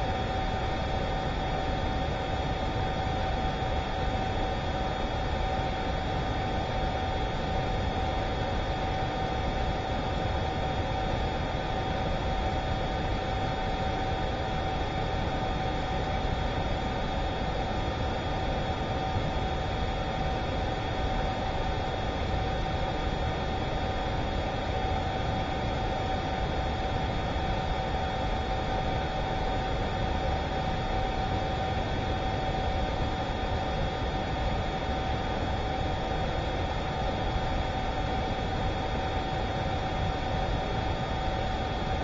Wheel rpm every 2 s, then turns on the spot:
0, 0, 0, 0, 0, 0, 0, 0, 0, 0, 0, 0, 0, 0, 0, 0, 0, 0, 0, 0, 0.
none